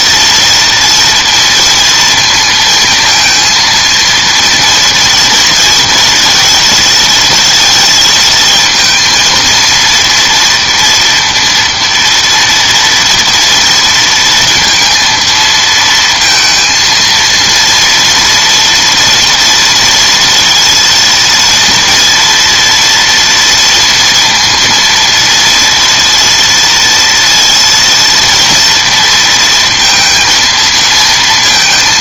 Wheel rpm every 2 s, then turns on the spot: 230, 230, 230, 230, 230, 230, 230, 230, 230, 240, 230, 240, 230, 230, 230, 230.
none